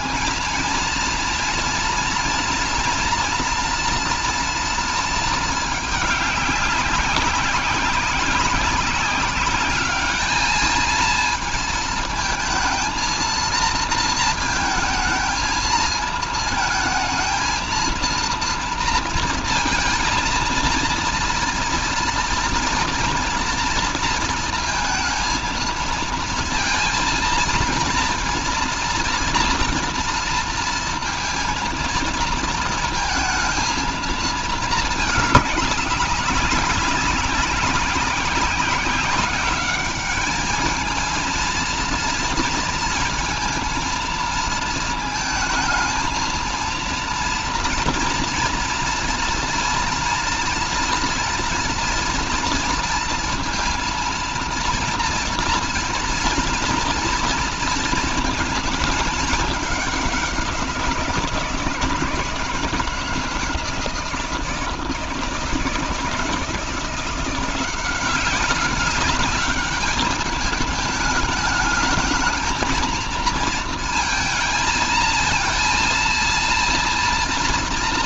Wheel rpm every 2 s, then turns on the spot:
230, 240, 230, 190, 190, 220, 230, 220, 220, 230, 230, 230, 220, 230, 230, 230, 230, 220, 190, 200, 220, 230, 220, 230, 230, 230, 230, 230, 230, 220, 180, 160, 160, 170, 190, 210, 220, 230, 230.
none